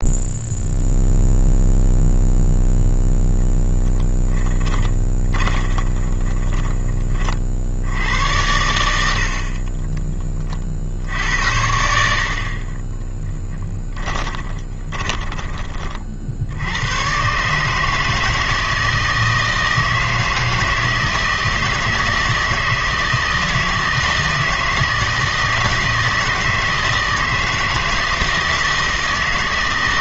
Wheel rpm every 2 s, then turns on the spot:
0, 0, 10, 30, 100, 50, 30, 20, 90, 160, 160, 160, 160, 160, 160.
4-8 12-16